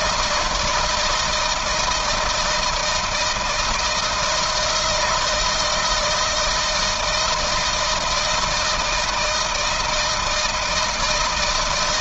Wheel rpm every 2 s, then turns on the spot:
160, 170, 160, 160, 160, 160.
none